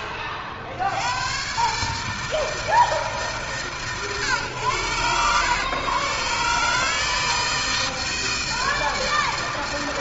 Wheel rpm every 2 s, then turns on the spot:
100, 160, 110, 150, 160.
none